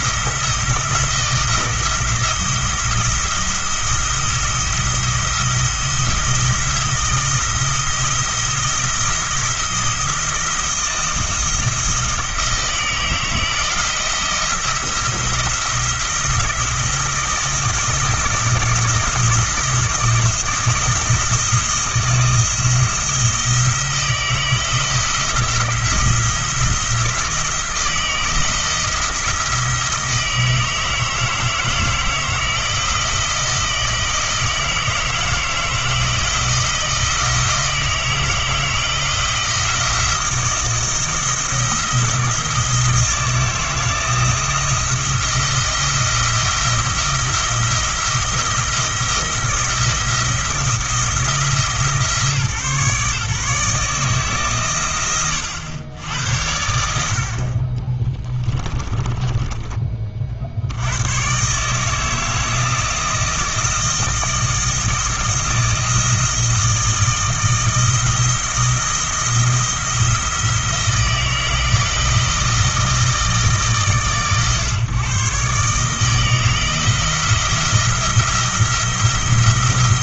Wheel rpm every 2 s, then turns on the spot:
170, 170, 170, 170, 170, 170, 170, 170, 170, 170, 170, 160, 160, 170, 170, 160, 170, 160, 160, 160, 170, 170, 170, 170, 170, 170, 140, 140, 70, 20, 60, 160, 160, 160, 170, 170, 160, 130, 160, 170.
58-60